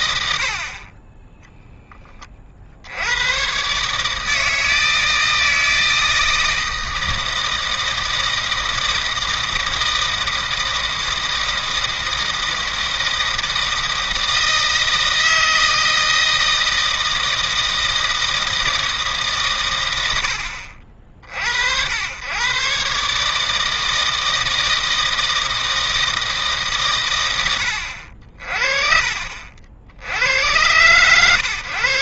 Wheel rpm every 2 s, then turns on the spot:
100, 60, 160, 160, 160, 160, 160, 160, 160, 160, 60, 130, 160, 150, 50, 120.
none